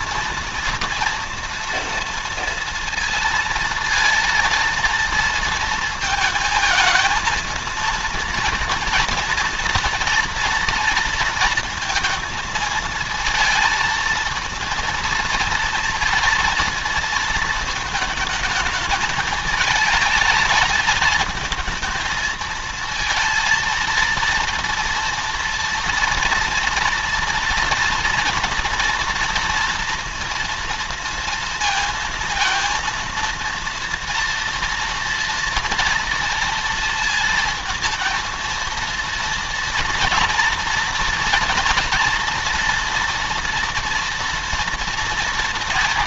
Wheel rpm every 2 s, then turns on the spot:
230, 230, 230, 230, 230, 230, 230, 230, 220, 220, 220, 230, 230, 230, 230, 230, 230, 230, 230, 230, 240, 240, 230.
none